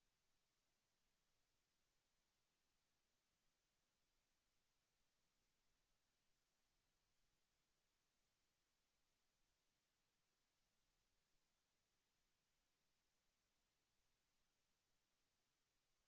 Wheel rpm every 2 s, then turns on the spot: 0, 0, 0, 0, 0, 0, 0, 0.
none